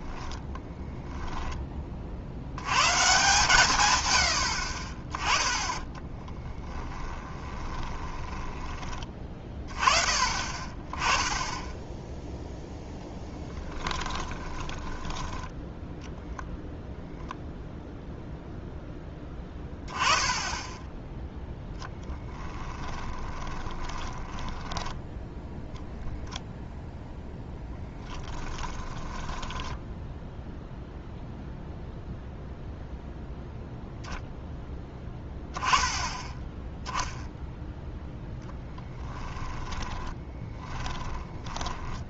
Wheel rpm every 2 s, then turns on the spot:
10, 100, 40, 20, 20, 30, 0, 10, 10, 0, 10, 20, 10, 10, 10, 0, 0, 10, 10, 10, 20.
0-2 6-8 14-16 22-26 28-30 38-42